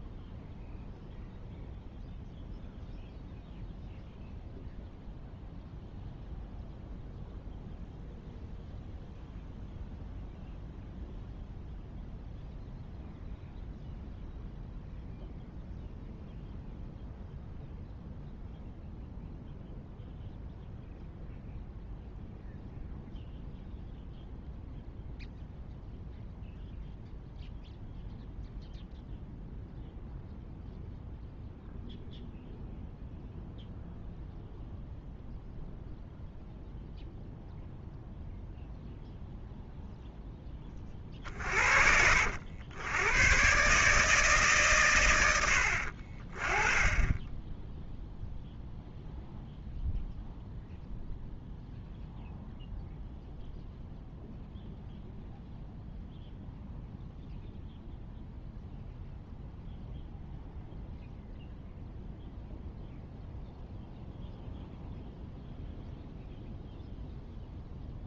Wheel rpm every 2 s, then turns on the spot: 0, 0, 0, 0, 0, 0, 0, 0, 0, 0, 0, 0, 0, 0, 0, 0, 0, 0, 0, 0, 20, 80, 130, 20, 0, 0, 0, 0, 0, 0, 0, 0, 0, 0.
none